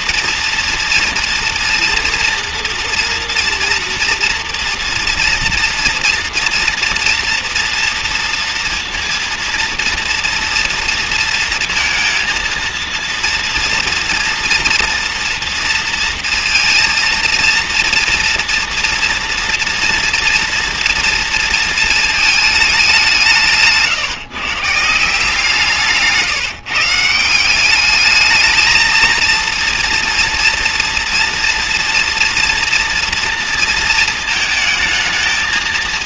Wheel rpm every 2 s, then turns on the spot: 230, 230, 240, 230, 230, 230, 230, 230, 230, 230, 230, 170, 170, 180, 230, 230, 230, 220.
none